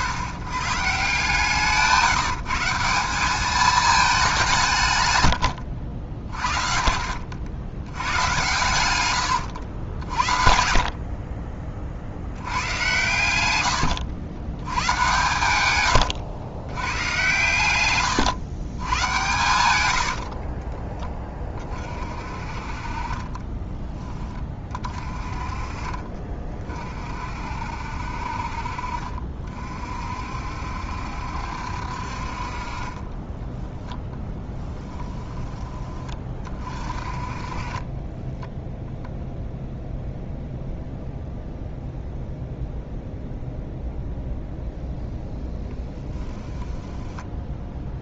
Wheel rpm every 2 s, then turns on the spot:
120, 170, 170, 50, 100, 70, 100, 110, 100, 110, 20, 40, 30, 40, 50, 60, 40, 10, 30, 0, 0, 0, 0, 10.
6-10 20-22 34-36 46-48